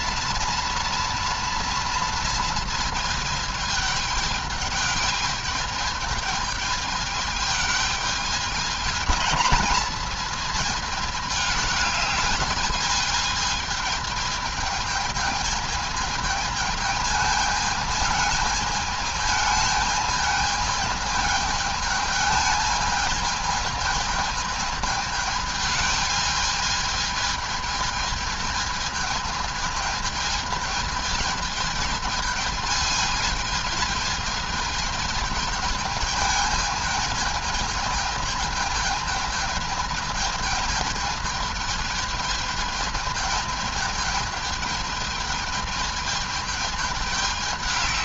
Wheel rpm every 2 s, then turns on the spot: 230, 230, 210, 210, 210, 220, 210, 210, 220, 220, 220, 220, 220, 210, 220, 220, 220, 220, 210, 220, 220, 220, 220, 210.
none